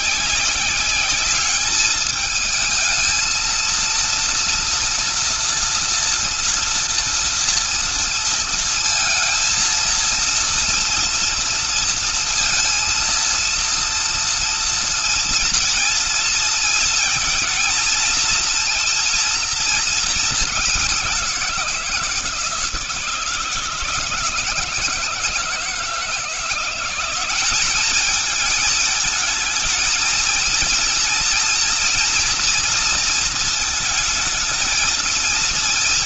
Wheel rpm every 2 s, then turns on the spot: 200, 220, 240, 230, 230, 230, 230, 230, 220, 230, 190, 160, 160, 180, 220, 240, 230, 230.
none